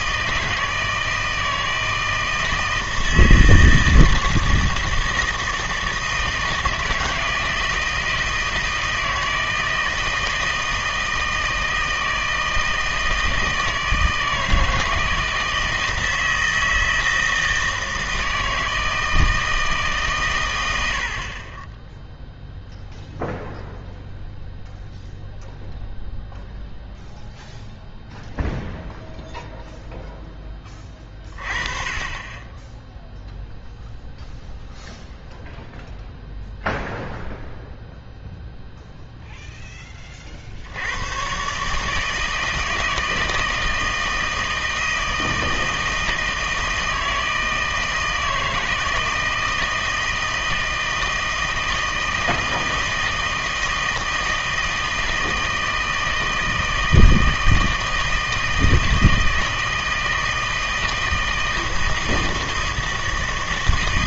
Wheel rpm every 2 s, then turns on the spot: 160, 160, 160, 160, 160, 160, 160, 160, 160, 160, 100, 0, 0, 0, 0, 10, 10, 0, 0, 0, 60, 160, 160, 160, 160, 160, 160, 160, 160, 160, 160, 160.
none